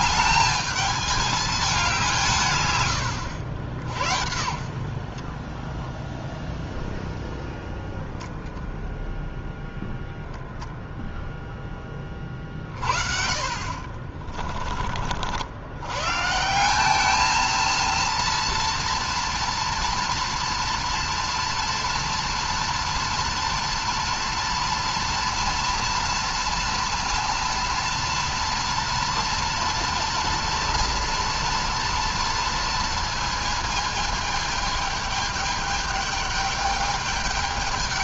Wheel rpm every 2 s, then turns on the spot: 210, 120, 50, 0, 0, 0, 40, 40, 190, 230, 230, 230, 230, 230, 240, 230, 230, 210, 210.
none